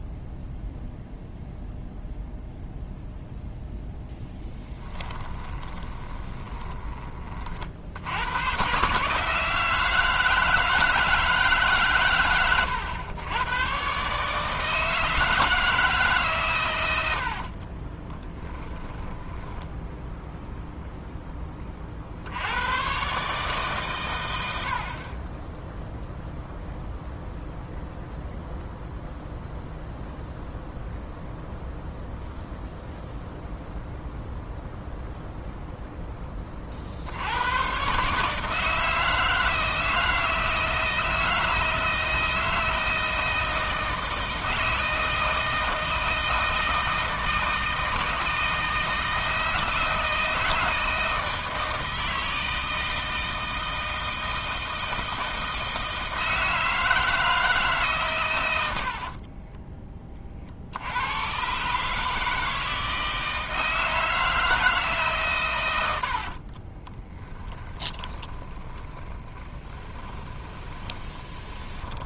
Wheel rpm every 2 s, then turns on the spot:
0, 0, 20, 20, 130, 160, 110, 160, 110, 20, 0, 120, 60, 0, 0, 0, 0, 0, 50, 160, 160, 160, 160, 160, 160, 160, 160, 160, 160, 70, 70, 160, 160, 20, 20, 20.
4-8 58-60 66-72